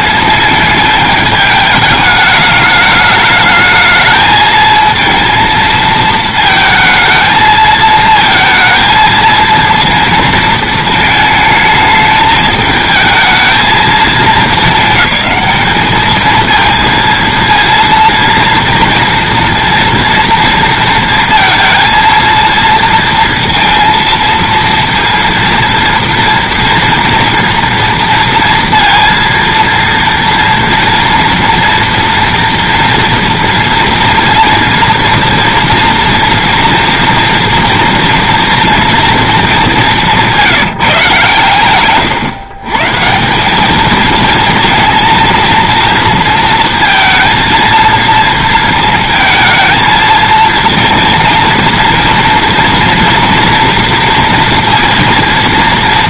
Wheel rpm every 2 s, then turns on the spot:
210, 210, 220, 220, 230, 230, 220, 200, 220, 230, 230, 230, 230, 240, 230, 230, 230, 230, 230, 230, 170, 130, 230, 230, 230, 230, 230, 230.
none